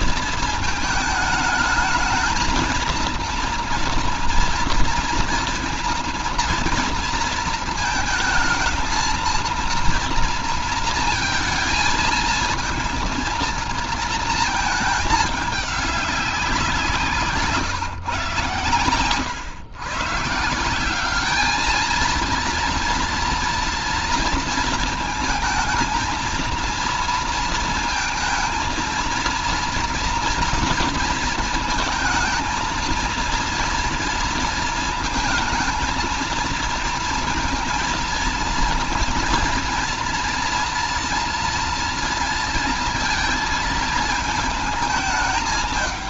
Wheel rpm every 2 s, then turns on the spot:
220, 220, 240, 230, 220, 230, 230, 220, 180, 130, 160, 230, 230, 230, 230, 230, 220, 230, 230, 230, 230, 230, 220.
none